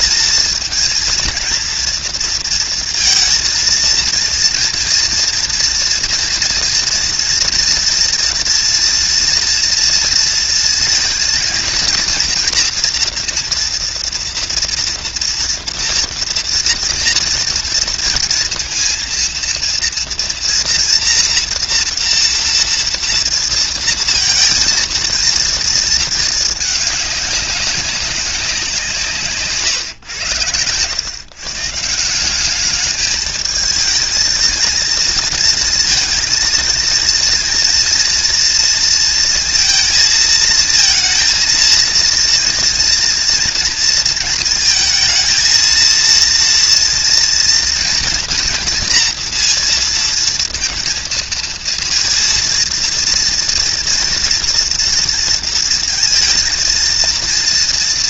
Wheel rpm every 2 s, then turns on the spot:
230, 230, 230, 240, 230, 230, 230, 230, 230, 230, 230, 230, 230, 220, 180, 110, 210, 230, 230, 230, 220, 230, 220, 230, 230, 230, 230, 230, 230.
none